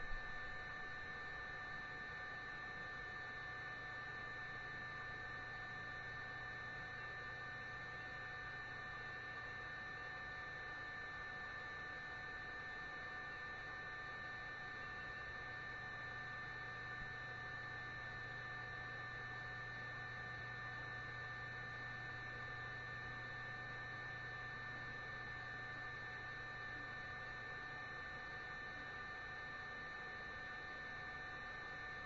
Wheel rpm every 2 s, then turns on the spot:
0, 0, 0, 0, 0, 0, 0, 0, 0, 0, 0, 0, 0, 0, 0, 0.
none